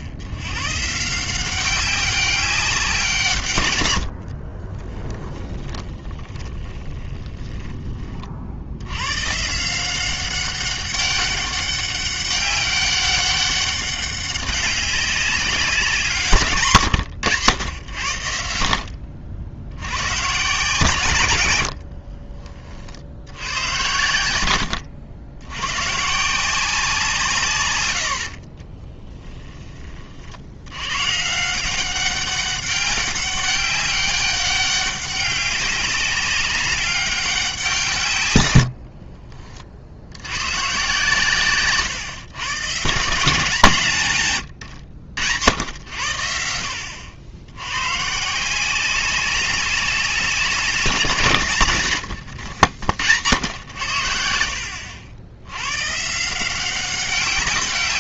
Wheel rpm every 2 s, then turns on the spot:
110, 190, 40, 20, 60, 190, 200, 190, 120, 80, 140, 40, 100, 170, 40, 100, 190, 200, 200, 100, 120, 130, 90, 70, 180, 180, 90, 70, 180.
4-8 16-18 28-30 44-46